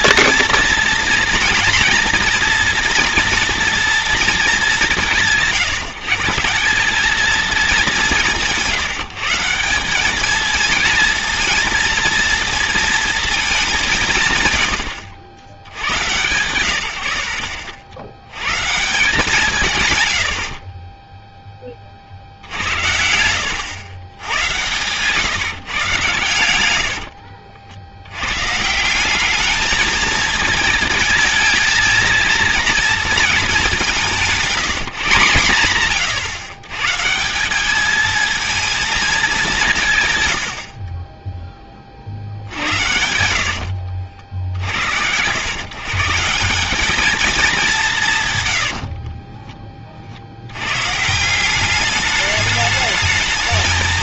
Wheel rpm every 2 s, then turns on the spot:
230, 240, 200, 190, 170, 230, 230, 90, 110, 150, 30, 80, 130, 100, 160, 230, 220, 180, 120, 230, 70, 70, 70, 200, 70, 110, 210.
20-24 26-28 42-44 48-50